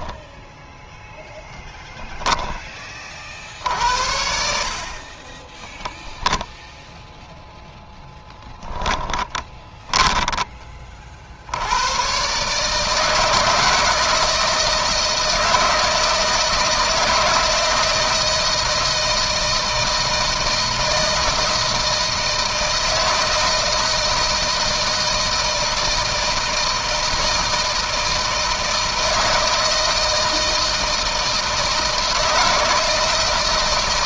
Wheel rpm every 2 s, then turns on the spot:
10, 50, 30, 10, 20, 50, 160, 160, 160, 160, 160, 160, 160, 160, 160, 160, 160.
0-2 4-6 8-10